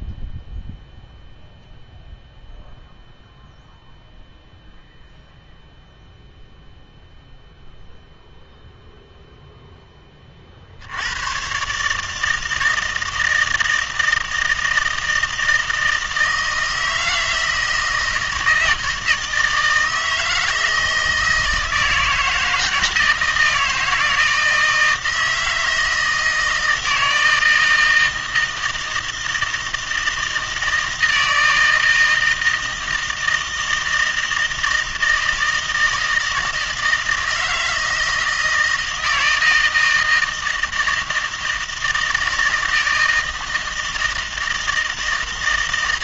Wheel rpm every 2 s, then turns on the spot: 0, 0, 0, 0, 0, 70, 160, 160, 160, 160, 160, 160, 160, 160, 160, 160, 160, 160, 160, 160, 160, 160, 160.
none